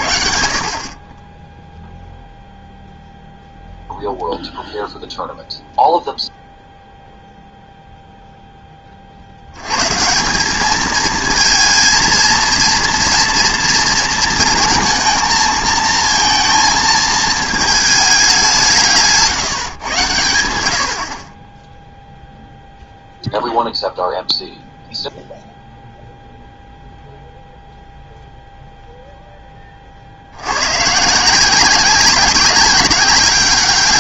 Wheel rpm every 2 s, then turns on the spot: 60, 0, 0, 0, 10, 210, 240, 230, 220, 180, 80, 0, 0, 0, 0, 110, 200.
none